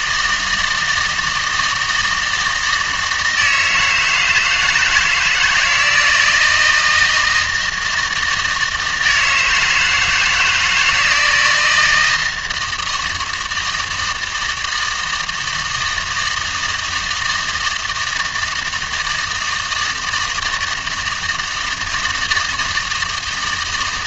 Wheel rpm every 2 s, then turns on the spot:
160, 160, 160, 160, 160, 160, 160, 160, 160, 160, 160, 160.
none